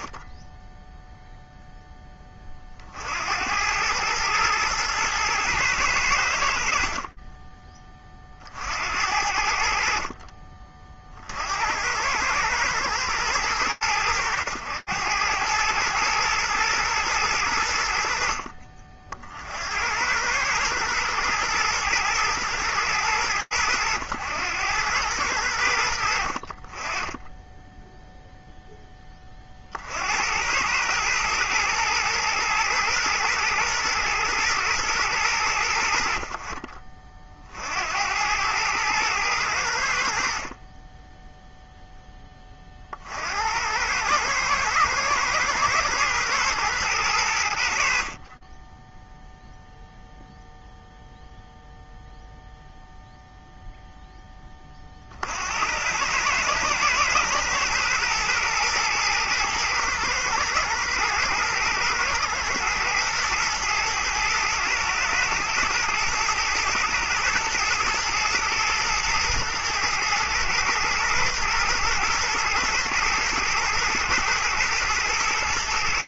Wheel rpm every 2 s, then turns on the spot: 0, 90, 110, 20, 70, 70, 100, 100, 100, 60, 120, 100, 80, 10, 30, 110, 110, 90, 50, 100, 0, 70, 120, 90, 0, 0, 0, 70, 110, 110, 110, 110, 110, 110, 110, 120, 120, 110.
none